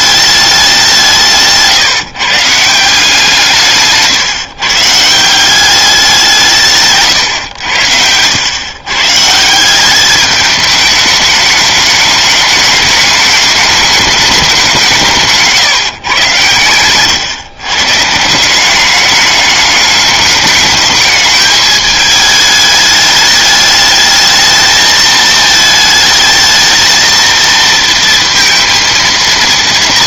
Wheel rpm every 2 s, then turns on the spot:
190, 160, 150, 150, 110, 210, 210, 190, 120, 190, 210, 210, 220, 220, 230.
none